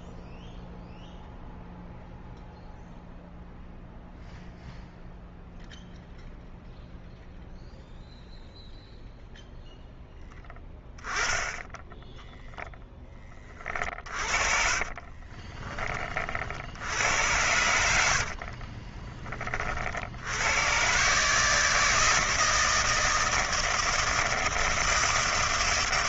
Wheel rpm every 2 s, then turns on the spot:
0, 0, 0, 0, 0, 10, 0, 40, 60, 40, 110, 160, 160.
14-16 18-20